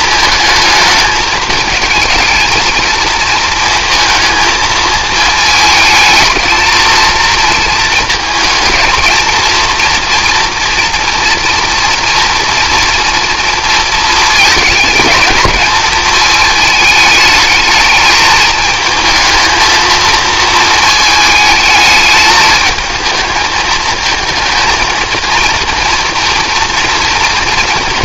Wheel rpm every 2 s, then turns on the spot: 220, 220, 220, 220, 220, 230, 230, 220, 220, 220, 220, 220, 220, 230.
none